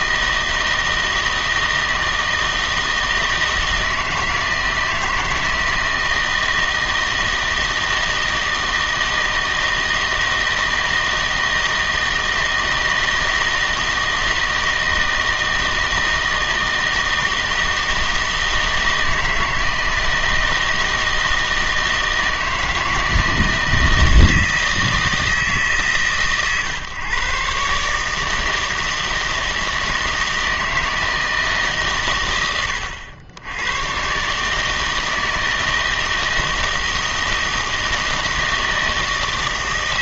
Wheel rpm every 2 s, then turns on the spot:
160, 160, 160, 160, 160, 160, 160, 160, 160, 160, 160, 160, 160, 130, 160, 160, 90, 150, 160, 160.
none